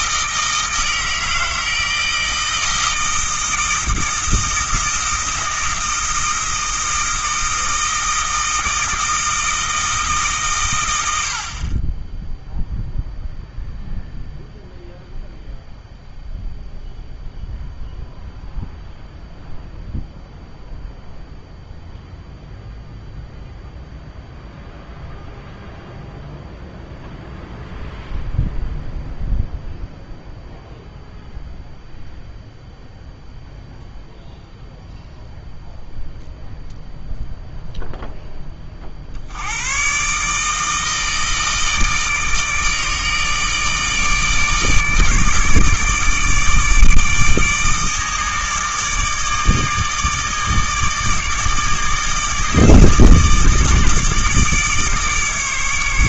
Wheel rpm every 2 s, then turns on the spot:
160, 160, 160, 160, 160, 100, 0, 0, 0, 0, 0, 0, 0, 0, 0, 0, 0, 0, 0, 50, 160, 150, 150, 150, 150, 150, 160, 150.
none